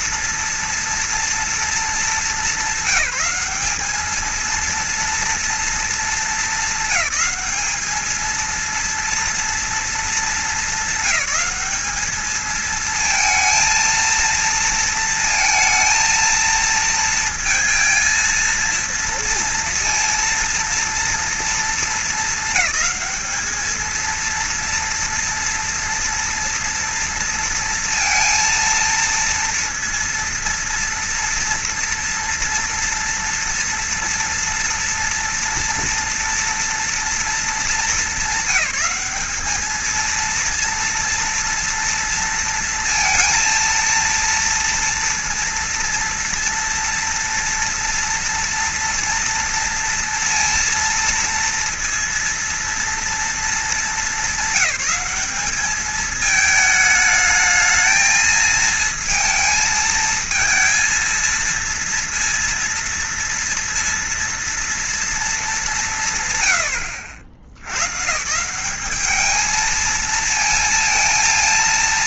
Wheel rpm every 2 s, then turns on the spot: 230, 200, 230, 220, 230, 210, 220, 230, 230, 230, 230, 220, 230, 230, 230, 230, 230, 230, 230, 200, 230, 230, 230, 230, 230, 230, 230, 210, 220, 230, 230, 230, 240, 100, 190, 230.
none